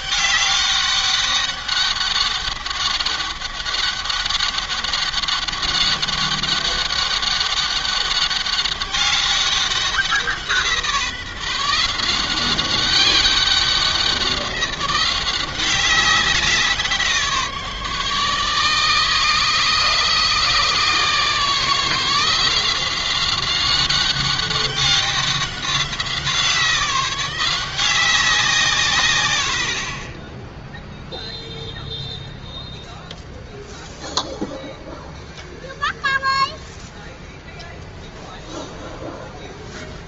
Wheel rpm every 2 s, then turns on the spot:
200, 200, 190, 200, 200, 170, 190, 180, 180, 150, 150, 170, 190, 180, 160, 10, 0, 0, 0, 0.
none